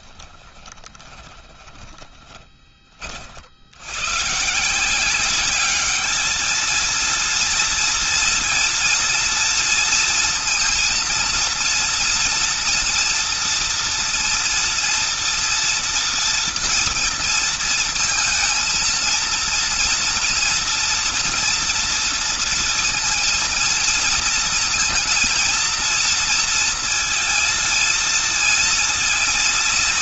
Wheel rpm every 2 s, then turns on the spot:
20, 30, 170, 220, 230, 230, 240, 230, 230, 230, 230, 230, 230, 230, 230.
0-2